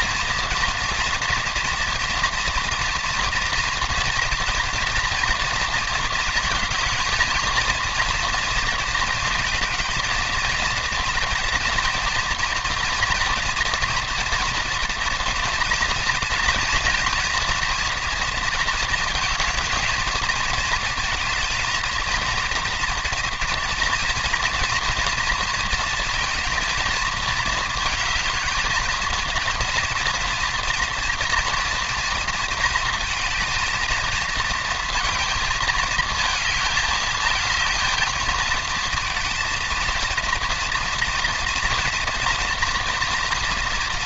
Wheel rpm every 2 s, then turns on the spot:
240, 240, 240, 220, 220, 230, 230, 240, 230, 230, 220, 230, 230, 230, 230, 230, 220, 230, 220, 230, 230, 240.
none